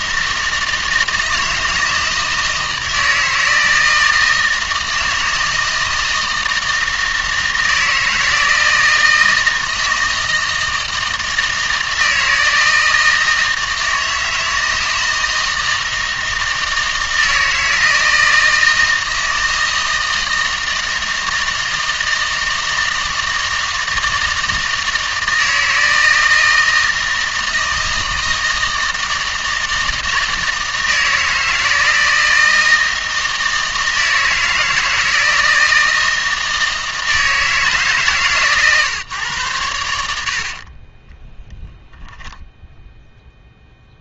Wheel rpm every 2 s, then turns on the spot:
160, 160, 160, 160, 160, 160, 160, 160, 160, 160, 160, 160, 160, 160, 160, 160, 160, 160, 160, 150, 40, 0.
40-42